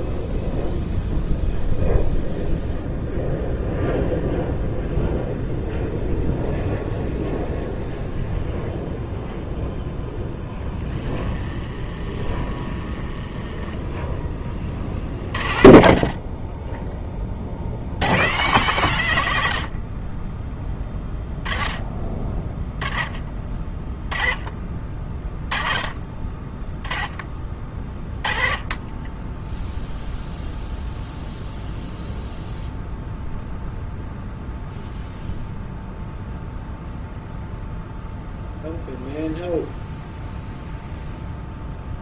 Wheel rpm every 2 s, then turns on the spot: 0, 0, 0, 0, 0, 10, 20, 40, 20, 140, 10, 20, 30, 10, 20, 0, 0, 0, 0, 0, 0.
none